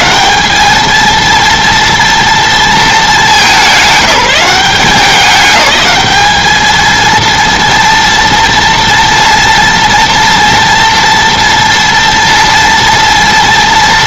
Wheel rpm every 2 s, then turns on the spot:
210, 230, 190, 210, 230, 240, 230.
none